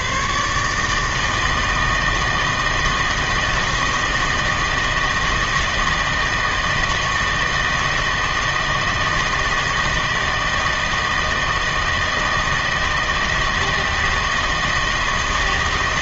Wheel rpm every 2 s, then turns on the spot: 140, 160, 160, 160, 160, 160, 170, 160.
none